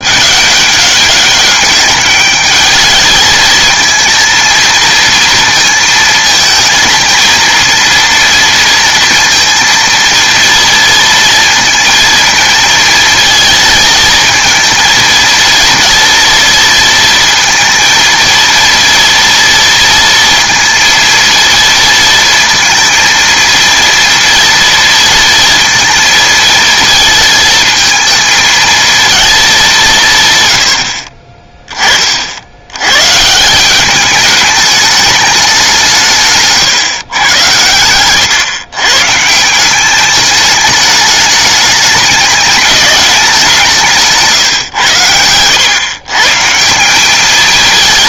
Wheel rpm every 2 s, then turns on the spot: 200, 210, 230, 220, 230, 230, 230, 230, 230, 230, 230, 230, 230, 230, 220, 100, 100, 210, 140, 130, 210, 200, 110, 180.
none